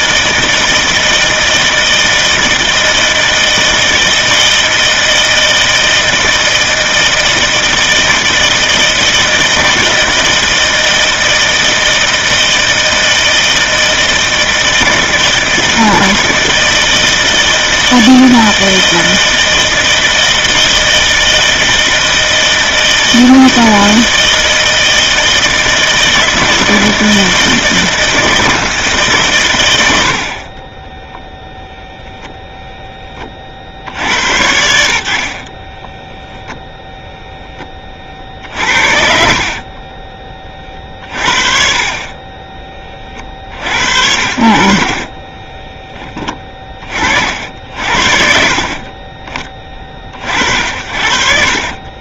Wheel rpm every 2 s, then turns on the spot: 160, 160, 160, 160, 160, 160, 160, 160, 160, 160, 160, 160, 160, 160, 160, 40, 0, 100, 0, 50, 30, 30, 60, 20, 50, 50.
30-32 44-46